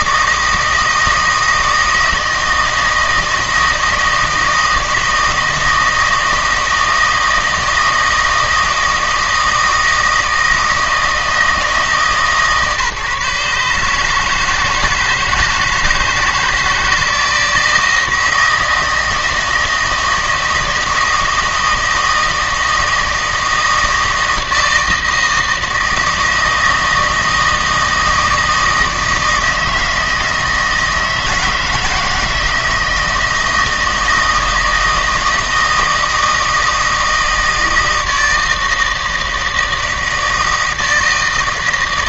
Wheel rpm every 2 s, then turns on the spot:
160, 160, 160, 160, 160, 160, 140, 160, 160, 160, 160, 160, 160, 160, 160, 160, 160, 160, 160, 160, 160.
none